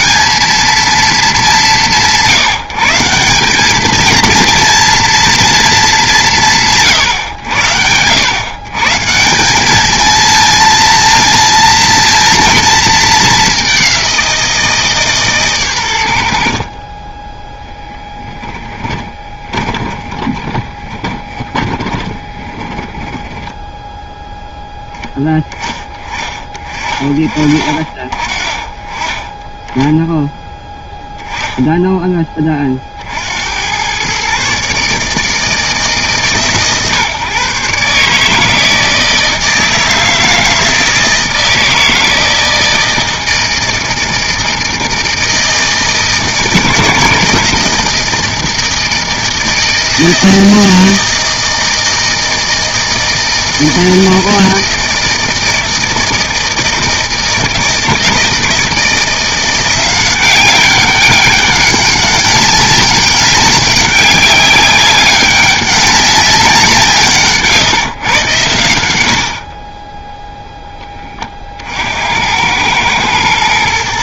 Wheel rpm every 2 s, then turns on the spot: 220, 180, 230, 170, 130, 230, 230, 170, 60, 10, 20, 20, 10, 30, 40, 0, 20, 140, 120, 160, 160, 160, 160, 150, 160, 160, 160, 160, 160, 160, 190, 200, 200, 180, 110, 0, 100.
18-24